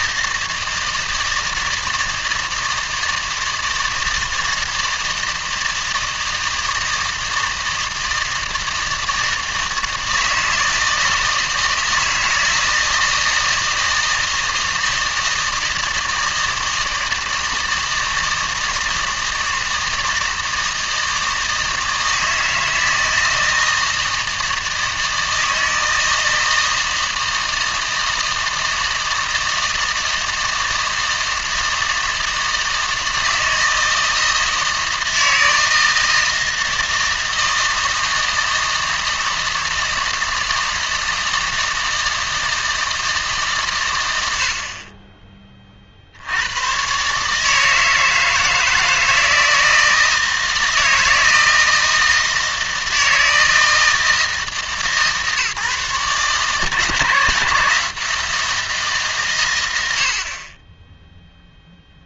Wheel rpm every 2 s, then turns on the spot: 160, 160, 160, 160, 160, 160, 160, 160, 160, 160, 160, 160, 160, 160, 160, 160, 160, 160, 160, 160, 160, 160, 50, 120, 160, 160, 160, 160, 160, 160, 20.
none